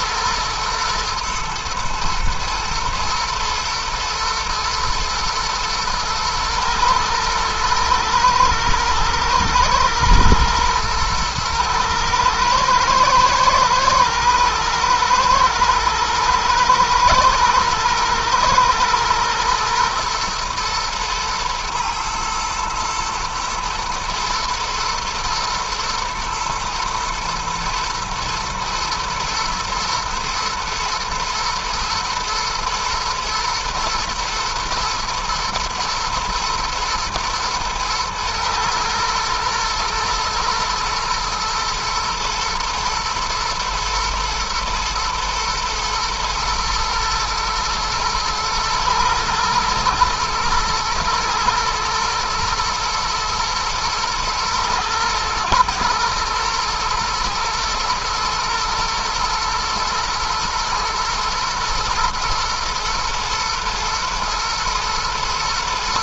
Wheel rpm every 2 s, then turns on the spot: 110, 110, 110, 120, 110, 120, 110, 110, 110, 110, 110, 110, 110, 110, 110, 110, 110, 120, 120, 110, 120, 110, 110, 120, 120, 110, 120, 110, 120, 120, 110, 110, 110.
none